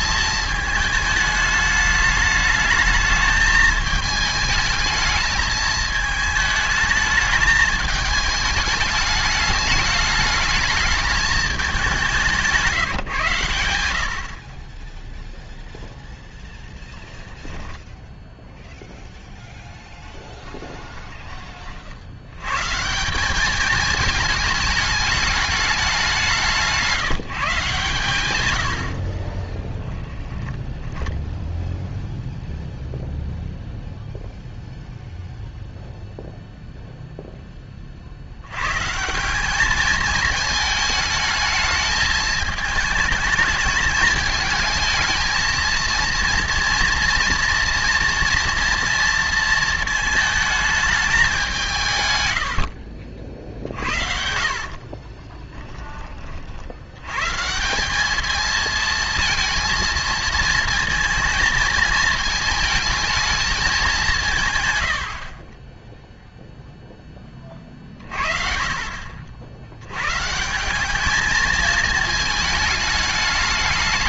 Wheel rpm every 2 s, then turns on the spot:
220, 220, 220, 220, 210, 220, 160, 20, 10, 0, 10, 150, 210, 170, 90, 10, 0, 0, 0, 140, 220, 210, 220, 230, 230, 210, 60, 40, 80, 220, 230, 220, 100, 0, 50, 190, 220.
16-18 20-22 30-32 52-56